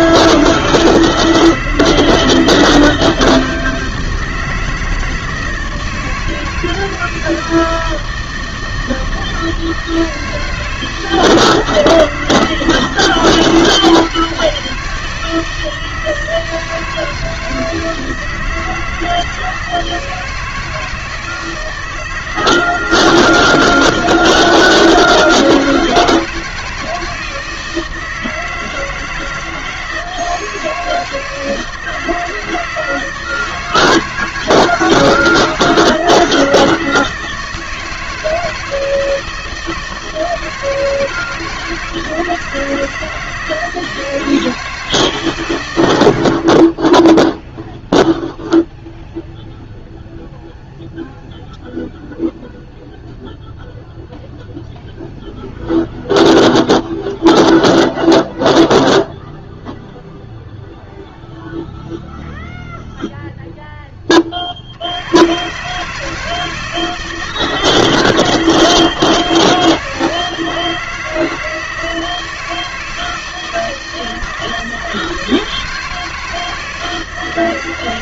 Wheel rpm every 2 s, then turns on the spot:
160, 160, 160, 160, 160, 160, 160, 160, 160, 160, 160, 160, 160, 160, 160, 160, 160, 160, 160, 160, 160, 160, 160, 20, 0, 0, 0, 0, 0, 0, 0, 0, 60, 160, 160, 160, 160, 160, 160.
none